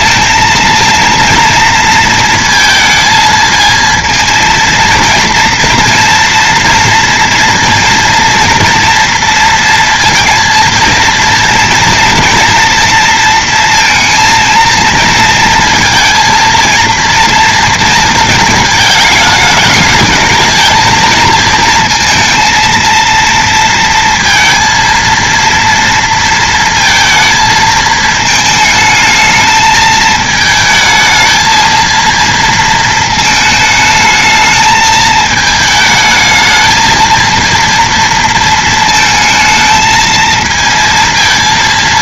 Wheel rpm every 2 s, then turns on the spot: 230, 220, 230, 230, 230, 230, 230, 230, 230, 220, 220, 230, 230, 230, 220, 220, 230, 220, 220, 220, 230.
none